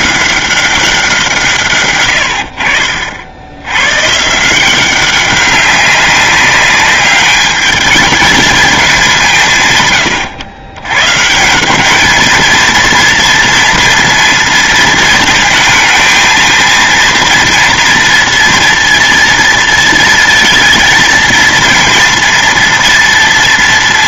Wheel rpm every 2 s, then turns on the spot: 190, 60, 180, 200, 200, 110, 230, 230, 230, 230, 230, 230.
none